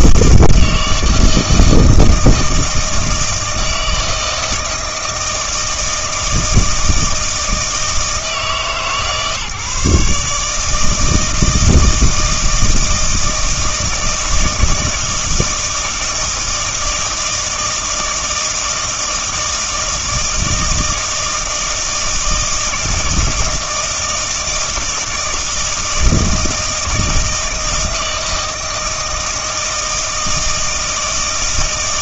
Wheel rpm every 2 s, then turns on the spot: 160, 160, 160, 160, 150, 150, 160, 160, 160, 160, 160, 160, 160, 160, 160, 160.
none